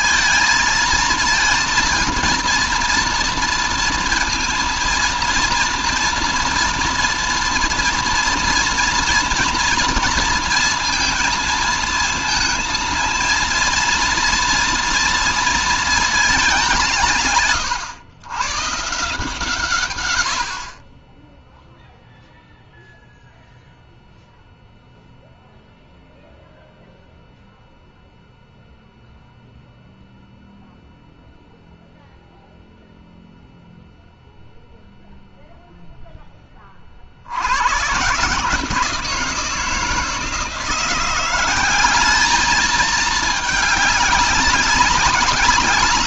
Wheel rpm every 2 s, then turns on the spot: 230, 230, 230, 230, 230, 230, 220, 230, 200, 150, 60, 0, 0, 0, 0, 0, 0, 0, 20, 150, 170, 210, 200.
none